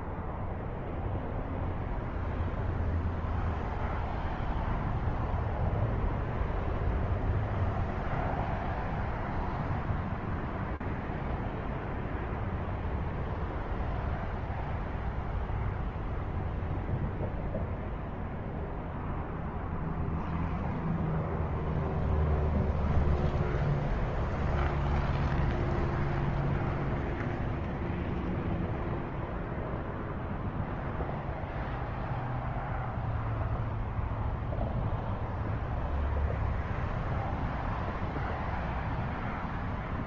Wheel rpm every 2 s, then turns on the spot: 0, 0, 0, 0, 0, 0, 0, 0, 0, 0, 0, 0, 0, 0, 0, 0, 0, 0, 0, 0.
none